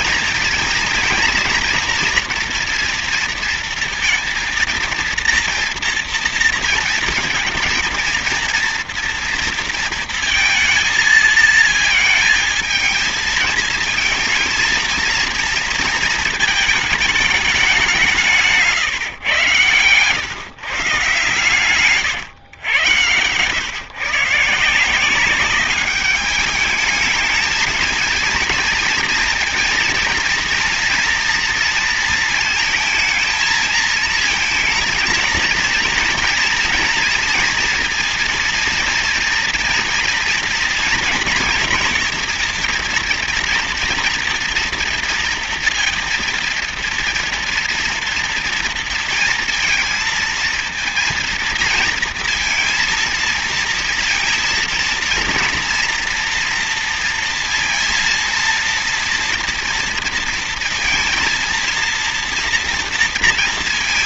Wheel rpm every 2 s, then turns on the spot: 230, 230, 230, 230, 230, 220, 220, 230, 220, 140, 130, 110, 170, 210, 230, 230, 220, 230, 230, 230, 240, 230, 230, 230, 230, 230, 230, 240, 230, 230, 230, 230.
18-20